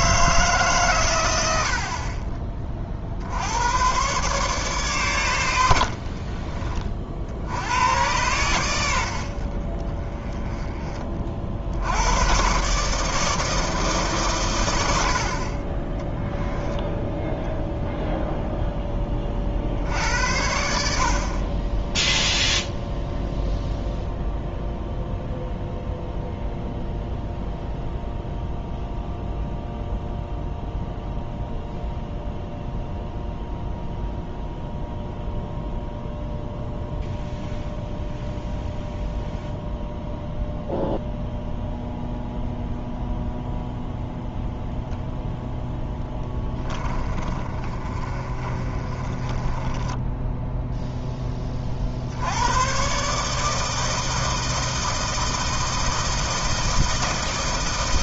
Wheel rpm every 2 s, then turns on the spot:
140, 30, 130, 40, 90, 20, 140, 90, 10, 10, 70, 0, 0, 0, 0, 0, 0, 0, 0, 0, 0, 0, 0, 20, 30, 0, 110, 160, 160.
16-18 46-50